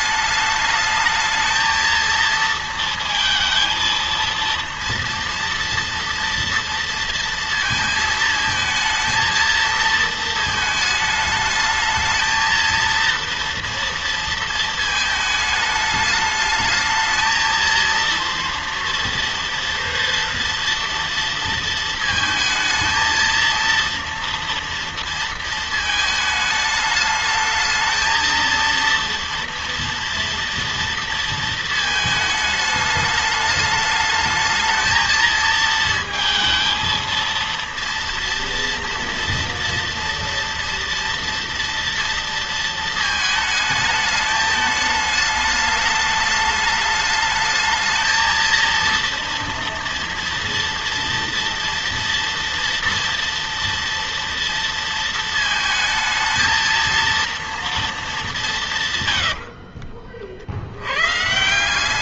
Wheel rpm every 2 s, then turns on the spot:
210, 230, 230, 230, 220, 220, 230, 230, 220, 230, 230, 220, 230, 220, 230, 230, 210, 220, 220, 230, 230, 230, 210, 210, 230, 230, 230, 230, 230, 170, 80.
none